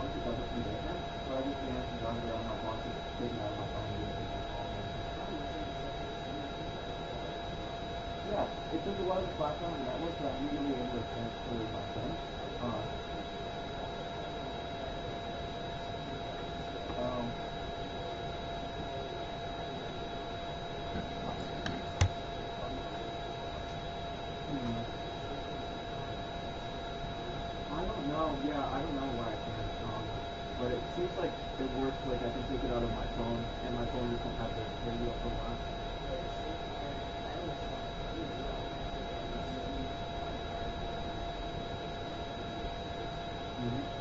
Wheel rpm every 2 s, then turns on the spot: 0, 0, 0, 0, 0, 0, 0, 0, 0, 0, 0, 0, 0, 0, 0, 0, 0, 0, 0, 0, 0, 0.
none